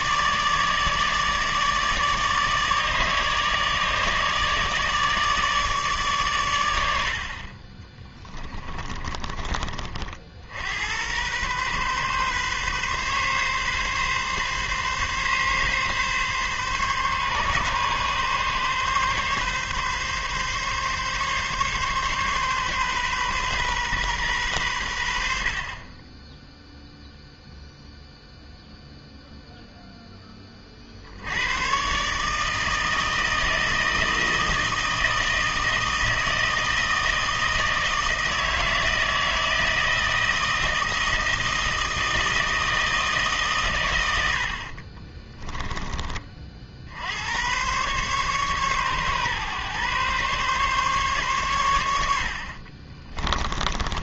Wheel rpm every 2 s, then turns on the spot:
150, 150, 150, 90, 30, 80, 140, 140, 140, 140, 140, 130, 100, 0, 0, 50, 160, 160, 160, 160, 160, 160, 40, 60, 130, 140, 50.
8-10 44-46 52-54